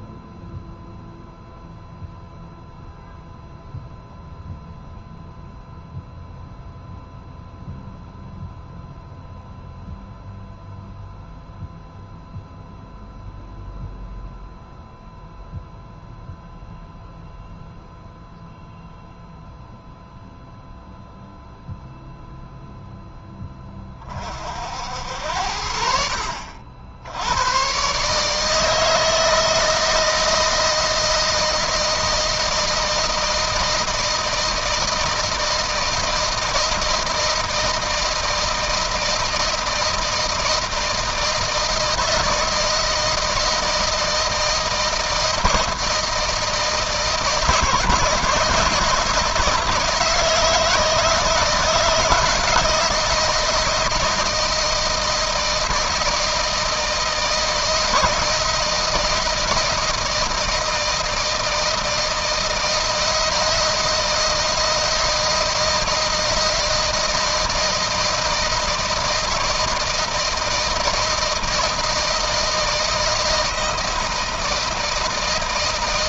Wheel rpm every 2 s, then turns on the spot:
0, 0, 0, 0, 0, 0, 0, 0, 0, 0, 0, 0, 70, 90, 160, 160, 160, 160, 160, 160, 160, 160, 160, 160, 160, 160, 160, 160, 160, 160, 160, 160, 160, 160, 160, 160, 160, 160.
none